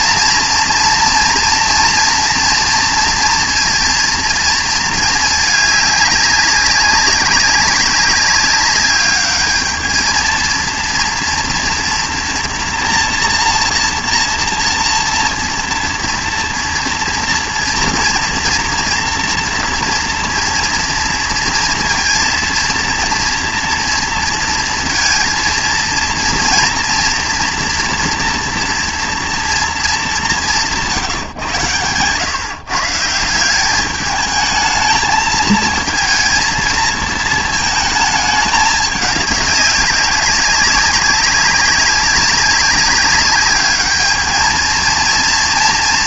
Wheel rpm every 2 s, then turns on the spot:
230, 230, 230, 200, 200, 230, 230, 230, 230, 230, 230, 230, 230, 240, 230, 180, 140, 220, 230, 210, 190, 190, 220.
none